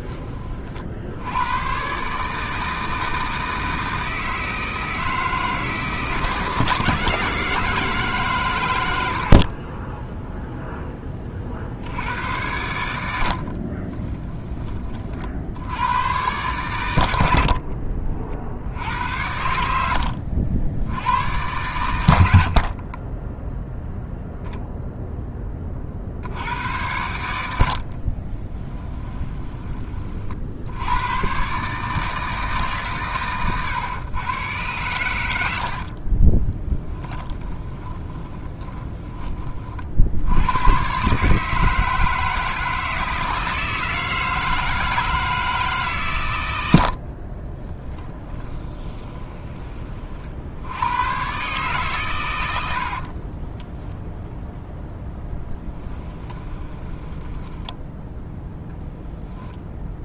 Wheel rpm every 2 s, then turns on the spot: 40, 160, 160, 160, 120, 0, 90, 20, 100, 20, 80, 60, 0, 90, 20, 60, 140, 110, 10, 20, 110, 160, 160, 90, 20, 80, 140, 0, 10, 0.
22-24 28-30 36-40 46-50 56-58